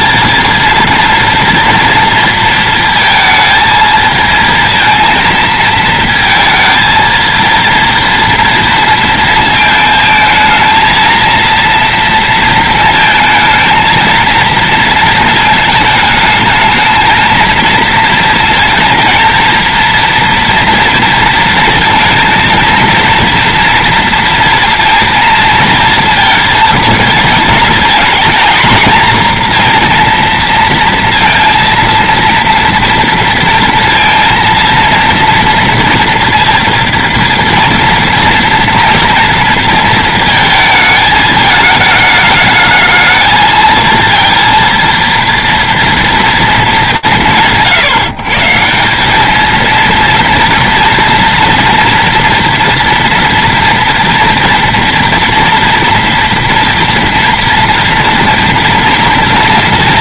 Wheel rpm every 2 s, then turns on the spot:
230, 220, 230, 230, 230, 230, 230, 230, 220, 230, 230, 230, 230, 230, 230, 230, 230, 230, 230, 230, 220, 220, 230, 150, 200, 230, 240, 230, 230, 230.
none